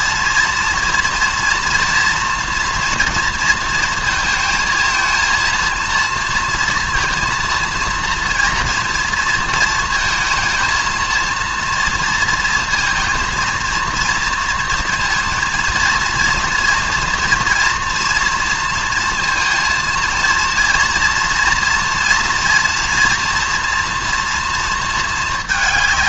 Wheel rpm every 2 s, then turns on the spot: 230, 230, 230, 230, 230, 230, 230, 230, 240, 230, 230, 240, 220.
none